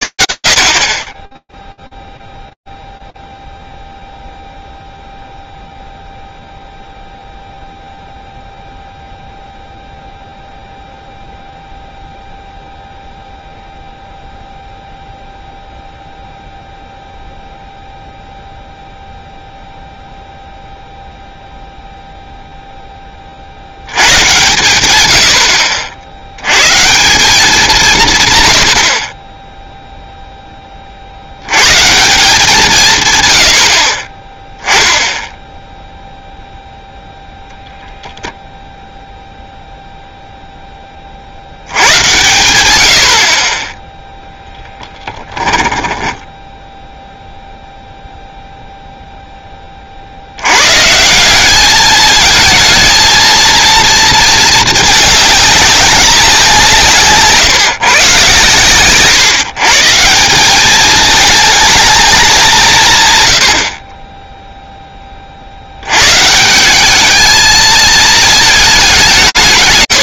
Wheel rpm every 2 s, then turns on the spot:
140, 0, 0, 0, 0, 0, 0, 0, 0, 0, 0, 50, 80, 180, 20, 70, 100, 10, 0, 0, 20, 80, 10, 0, 0, 150, 220, 210, 160, 130, 210, 140, 10, 200, 210.
44-46